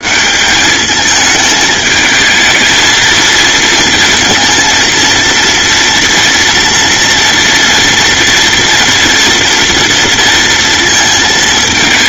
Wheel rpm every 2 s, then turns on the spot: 200, 230, 230, 230, 230, 230.
none